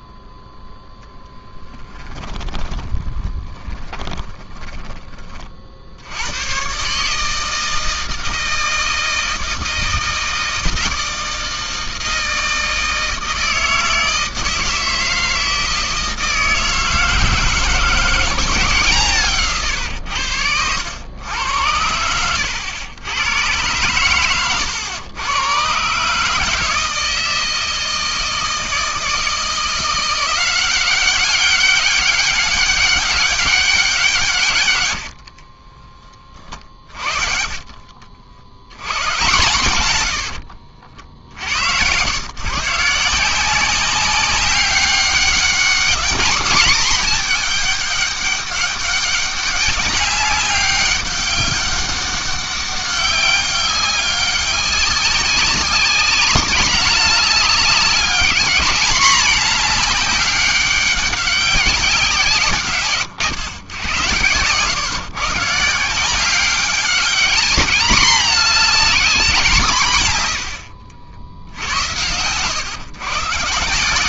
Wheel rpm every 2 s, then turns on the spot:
0, 20, 20, 140, 160, 160, 160, 160, 160, 150, 100, 90, 110, 160, 160, 190, 200, 100, 40, 110, 70, 160, 200, 220, 200, 200, 200, 200, 210, 210, 190, 140, 130, 200, 210, 80, 140.
2-4 34-38 40-42